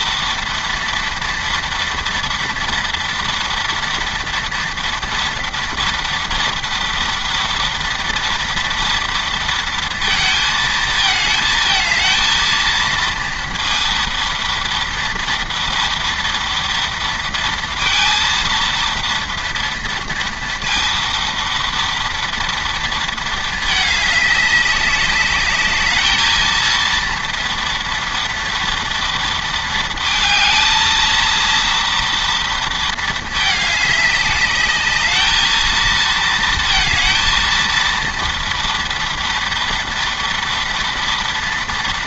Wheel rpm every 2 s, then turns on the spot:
230, 230, 230, 230, 230, 220, 230, 230, 230, 230, 230, 230, 200, 230, 230, 220, 230, 210, 230, 230, 230.
none